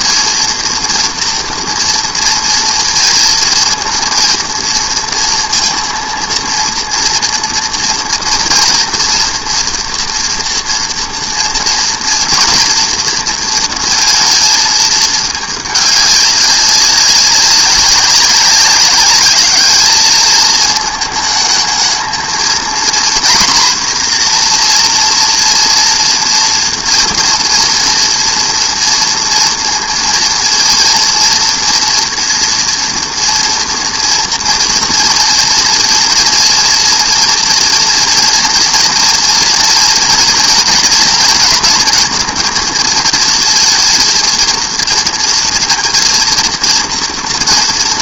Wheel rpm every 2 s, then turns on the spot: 230, 230, 230, 230, 230, 230, 230, 230, 200, 190, 220, 230, 240, 230, 230, 230, 230, 230, 230, 230, 240, 230, 230, 230.
none